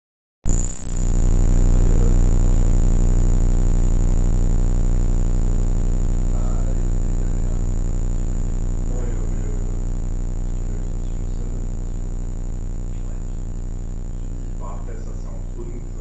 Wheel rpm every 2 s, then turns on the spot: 0, 0, 0, 0, 0, 0, 0, 0.
none